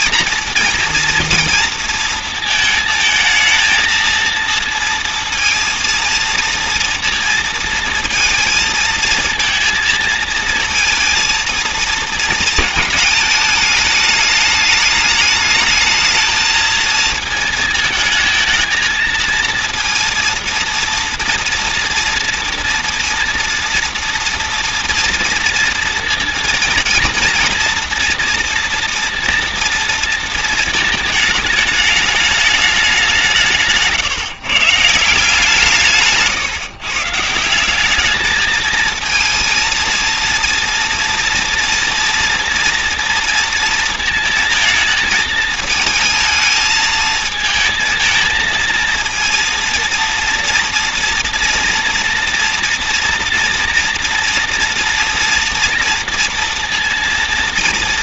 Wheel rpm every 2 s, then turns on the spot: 240, 220, 230, 230, 220, 220, 220, 210, 220, 220, 230, 230, 230, 230, 230, 220, 210, 140, 150, 220, 230, 230, 220, 220, 220, 230, 230, 230, 230.
none